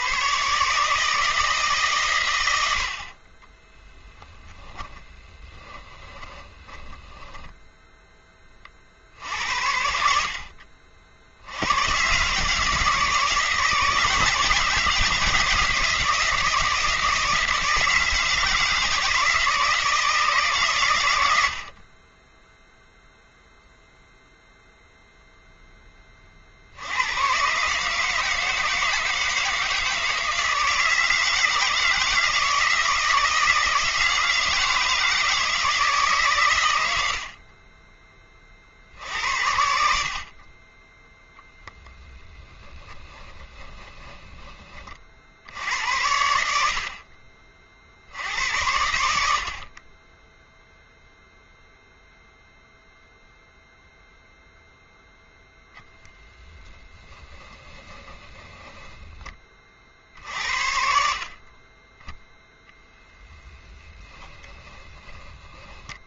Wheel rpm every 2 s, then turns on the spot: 140, 80, 10, 10, 40, 60, 150, 170, 170, 160, 120, 0, 0, 70, 160, 160, 160, 160, 100, 50, 20, 10, 30, 70, 80, 0, 0, 0, 10, 20, 60, 0, 20.
4-8 42-44 56-60 64-66